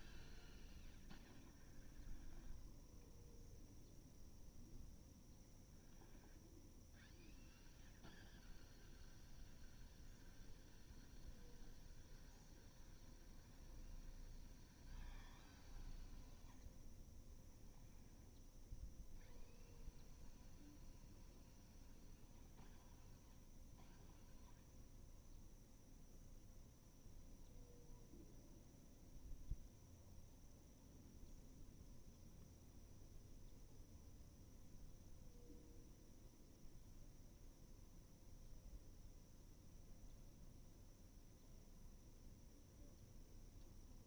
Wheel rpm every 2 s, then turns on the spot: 0, 0, 0, 0, 0, 0, 0, 0, 0, 0, 0, 0, 0, 0, 0, 0, 0, 0, 0, 0, 0, 0.
none